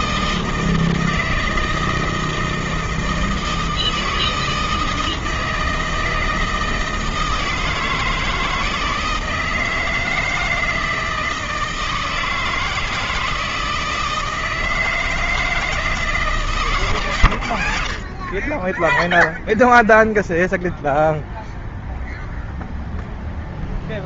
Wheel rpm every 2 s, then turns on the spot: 160, 160, 160, 160, 160, 160, 160, 160, 120, 0, 0, 0.
none